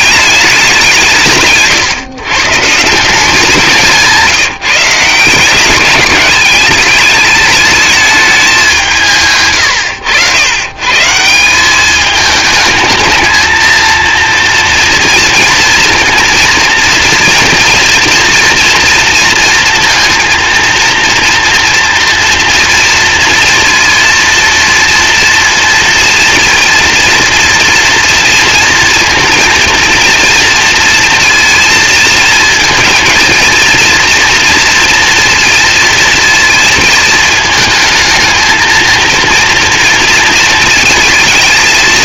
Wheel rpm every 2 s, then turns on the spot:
170, 170, 170, 210, 170, 160, 220, 230, 230, 230, 230, 230, 230, 230, 230, 230, 220, 230, 220, 220, 230.
none